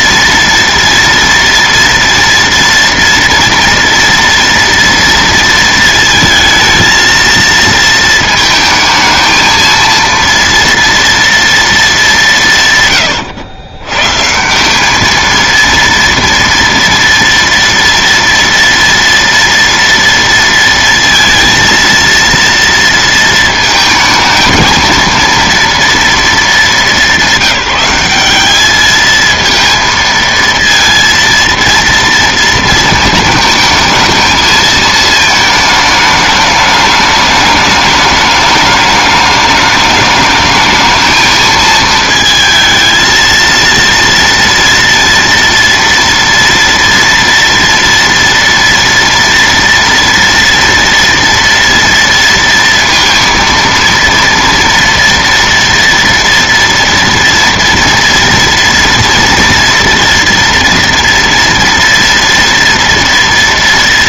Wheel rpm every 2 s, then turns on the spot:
230, 230, 230, 220, 220, 230, 150, 190, 230, 230, 230, 230, 230, 220, 210, 230, 230, 220, 210, 210, 210, 220, 230, 230, 230, 230, 230, 230, 230, 230, 230, 230.
none